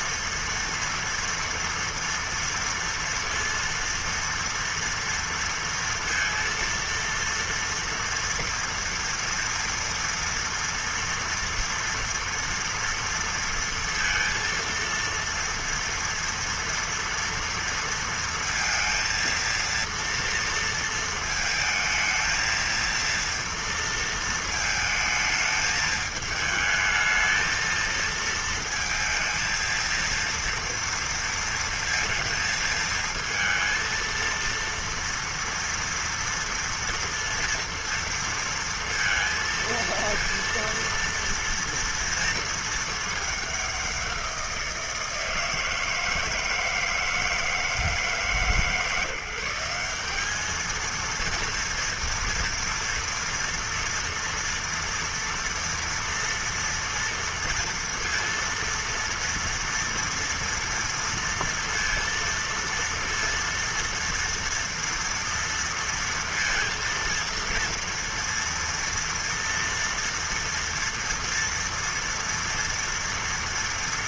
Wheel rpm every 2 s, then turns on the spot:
230, 230, 230, 230, 230, 230, 230, 230, 230, 230, 230, 220, 220, 220, 230, 230, 230, 230, 230, 230, 230, 220, 180, 160, 150, 210, 230, 230, 230, 230, 230, 230, 230, 230, 240, 230, 230.
none